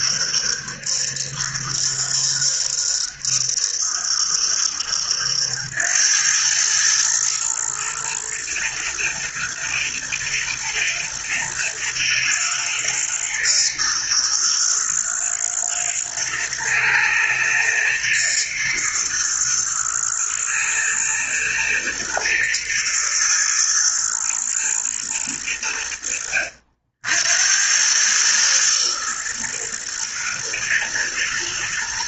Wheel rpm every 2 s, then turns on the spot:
70, 70, 70, 110, 110, 120, 110, 120, 110, 120, 120, 120, 110, 70, 110, 110.
none